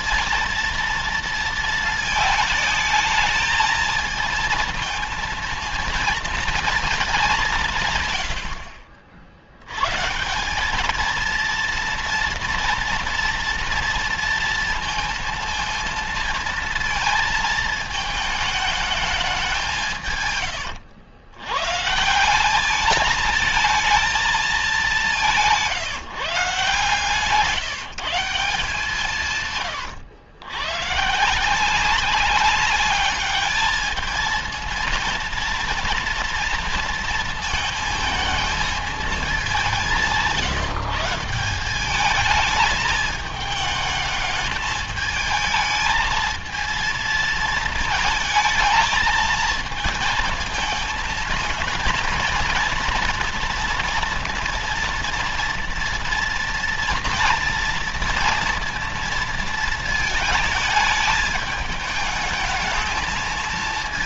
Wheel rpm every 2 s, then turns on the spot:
230, 220, 220, 230, 80, 190, 230, 230, 230, 220, 140, 200, 210, 150, 150, 110, 200, 230, 230, 220, 160, 220, 220, 230, 220, 230, 230, 230, 230, 230, 220, 220.
none